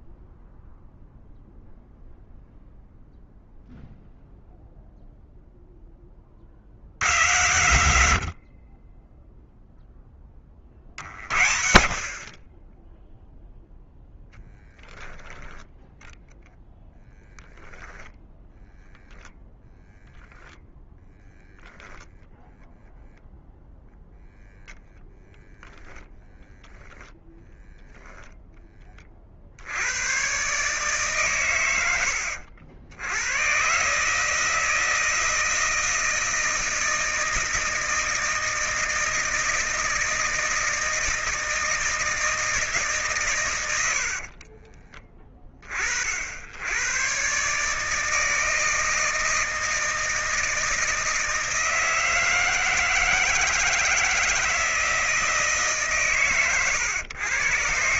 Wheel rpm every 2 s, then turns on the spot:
0, 0, 0, 40, 50, 20, 20, 0, 0, 10, 0, 0, 10, 10, 20, 130, 90, 160, 160, 160, 160, 150, 30, 80, 160, 160, 160, 160, 120.
24-28 44-46